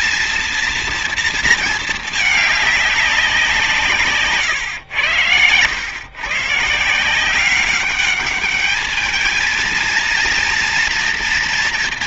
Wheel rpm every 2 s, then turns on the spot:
230, 210, 140, 150, 210, 230.
none